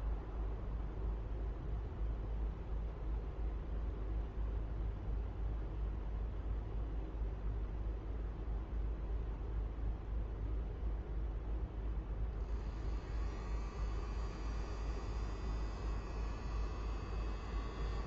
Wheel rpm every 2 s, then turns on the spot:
0, 0, 0, 0, 0, 0, 0, 0, 0.
none